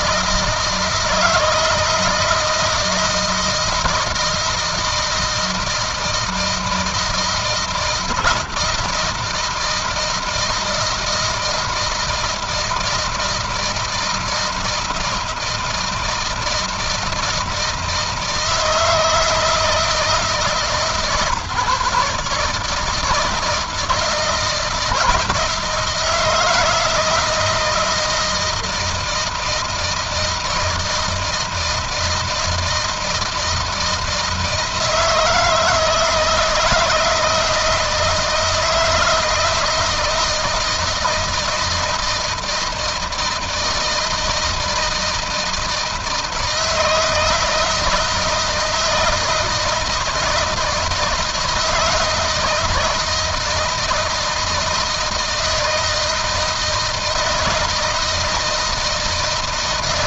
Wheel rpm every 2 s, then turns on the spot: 160, 160, 160, 160, 160, 160, 160, 160, 160, 160, 140, 160, 160, 160, 160, 160, 160, 160, 160, 160, 170, 160, 160, 160, 160, 160, 160, 160, 160, 160.
none